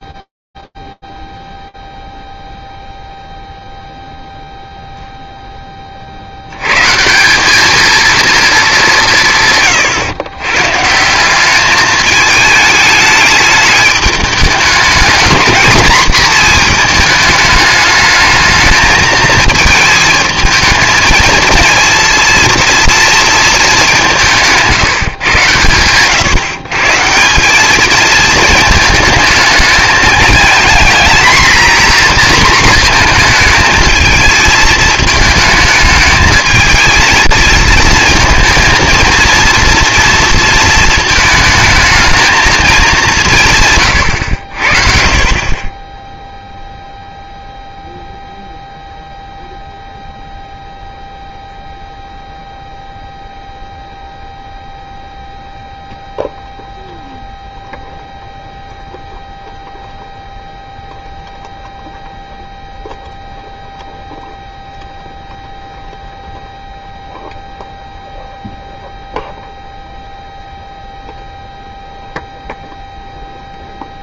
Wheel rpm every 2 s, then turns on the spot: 0, 0, 0, 150, 210, 140, 210, 220, 220, 220, 220, 230, 150, 160, 220, 220, 230, 220, 220, 230, 230, 200, 50, 0, 0, 0, 0, 0, 0, 0, 0, 0, 0, 0, 0, 0, 0.
none